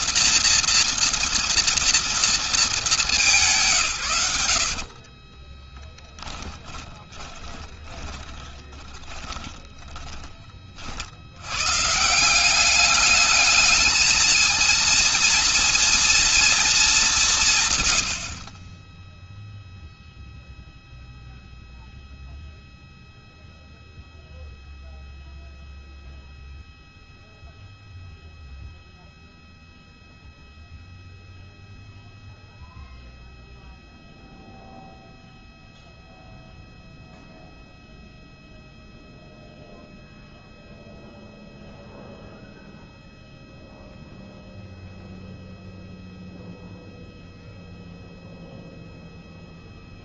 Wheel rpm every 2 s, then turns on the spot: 240, 230, 90, 10, 20, 30, 180, 220, 230, 50, 0, 0, 0, 0, 0, 0, 0, 0, 0, 0, 0, 0, 0, 0, 0.
4-10